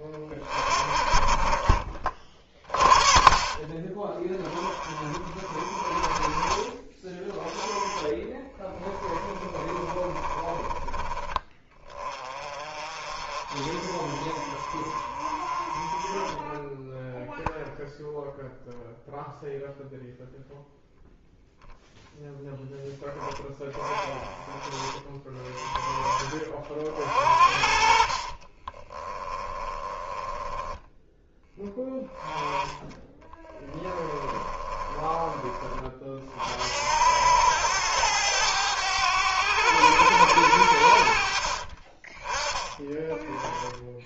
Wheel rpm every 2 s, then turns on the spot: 30, 40, 30, 30, 10, 20, 30, 40, 10, 0, 0, 0, 20, 30, 30, 10, 10, 20, 60, 100, 80, 20.
8-12 16-18 28-30 32-36